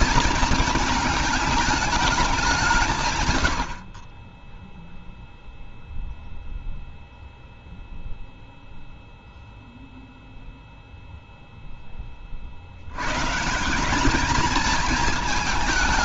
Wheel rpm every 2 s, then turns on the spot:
220, 190, 10, 0, 0, 0, 60, 220.
none